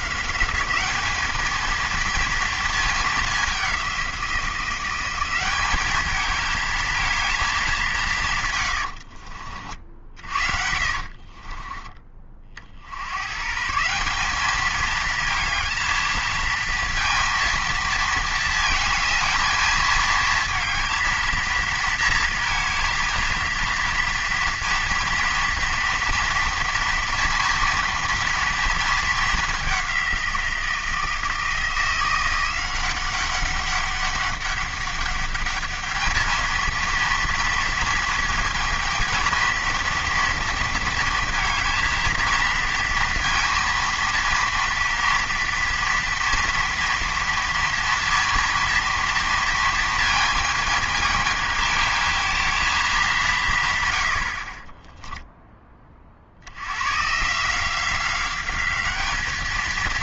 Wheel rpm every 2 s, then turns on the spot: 200, 220, 180, 220, 130, 50, 50, 210, 230, 230, 220, 230, 230, 230, 230, 170, 180, 200, 220, 220, 230, 230, 230, 230, 230, 220, 220, 40, 90, 200.
8-12